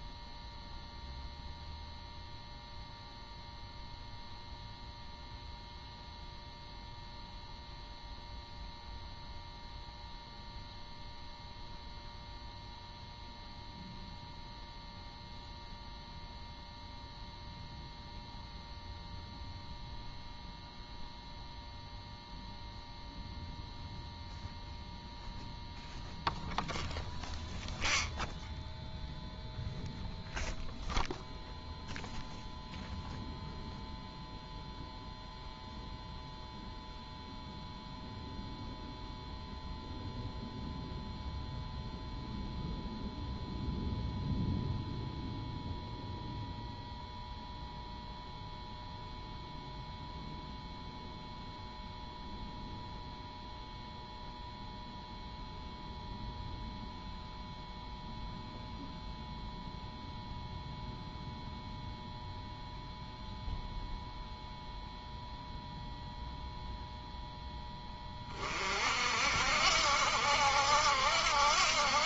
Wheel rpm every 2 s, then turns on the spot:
0, 0, 0, 0, 0, 0, 0, 0, 0, 0, 0, 0, 0, 0, 0, 0, 0, 0, 0, 0, 0, 0, 0, 0, 0, 0, 0, 0, 0, 0, 0, 0, 0, 0, 50, 70.
none